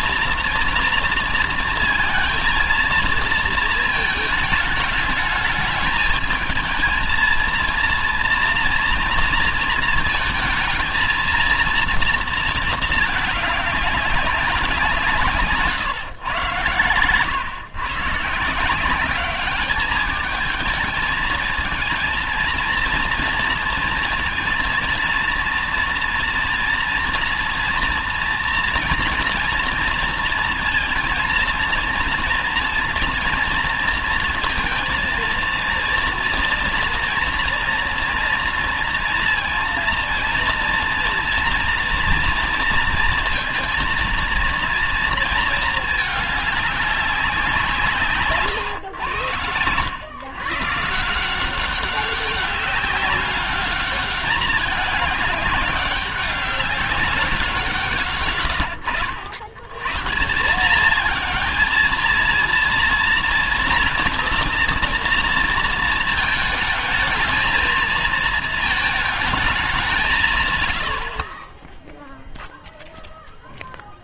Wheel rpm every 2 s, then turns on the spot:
230, 230, 220, 220, 230, 230, 230, 190, 130, 160, 220, 230, 230, 230, 230, 230, 230, 230, 230, 230, 230, 230, 230, 200, 120, 130, 200, 210, 200, 110, 190, 230, 230, 220, 220, 130, 0.
none